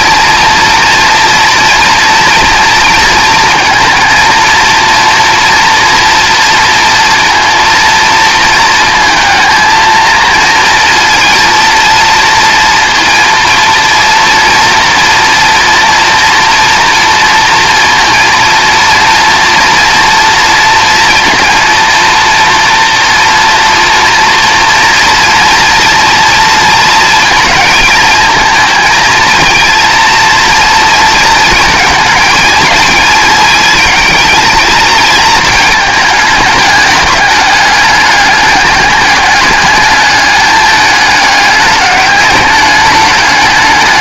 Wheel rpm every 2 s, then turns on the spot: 230, 230, 230, 230, 230, 230, 230, 230, 230, 230, 230, 230, 230, 230, 220, 230, 230, 230, 210, 210, 210, 200.
none